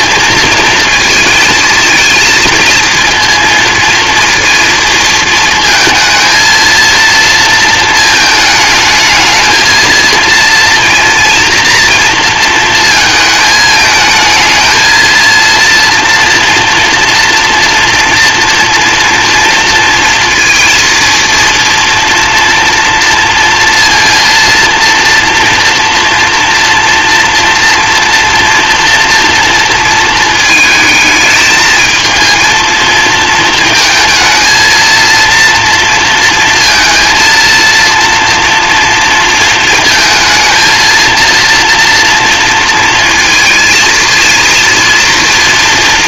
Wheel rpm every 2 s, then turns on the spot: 230, 230, 230, 230, 220, 230, 220, 230, 230, 230, 230, 230, 230, 230, 230, 220, 230, 230, 230, 230, 230, 230, 230.
none